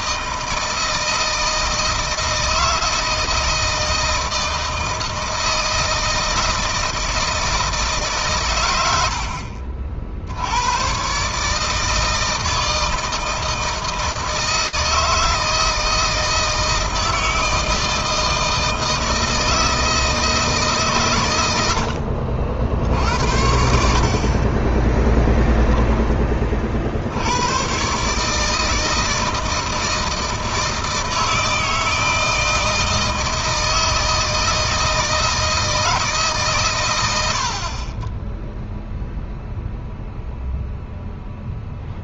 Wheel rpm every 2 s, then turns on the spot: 160, 160, 160, 160, 100, 110, 160, 160, 160, 160, 140, 60, 20, 60, 160, 160, 160, 160, 110, 0, 0.
24-26